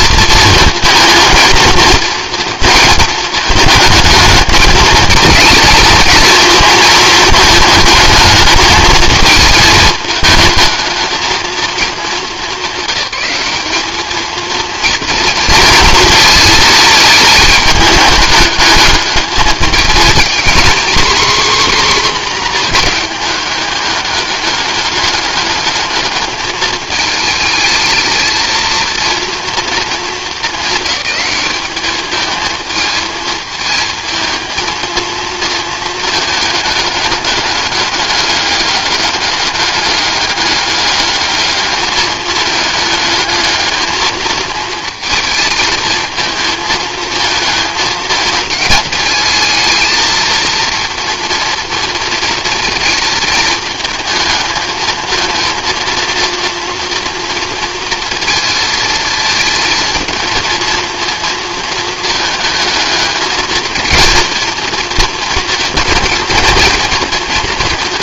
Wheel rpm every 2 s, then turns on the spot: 220, 220, 220, 220, 220, 220, 210, 230, 220, 210, 250, 230, 210, 220, 230, 210, 220, 220, 210, 200, 210, 210, 230, 220, 220, 230, 230, 220, 230, 230, 230, 220, 230, 230.
none